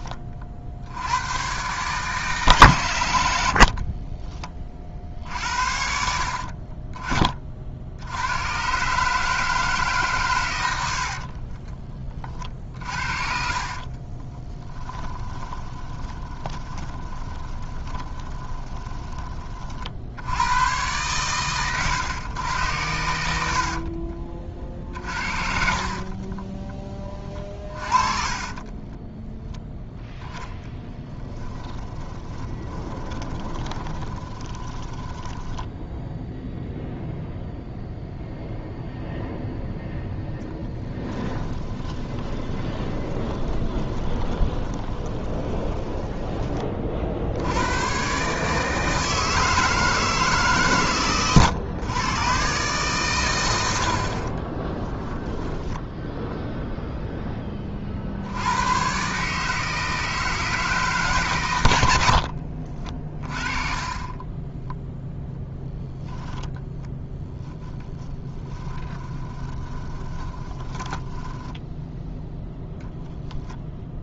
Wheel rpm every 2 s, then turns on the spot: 50, 130, 50, 40, 110, 100, 50, 20, 20, 20, 100, 110, 40, 20, 30, 0, 20, 20, 0, 0, 10, 20, 20, 20, 160, 140, 120, 30, 0, 90, 160, 50, 10, 0, 10, 20, 0.
6-8 12-20 24-26 28-30 32-36 40-46 54-56 62-64 68-72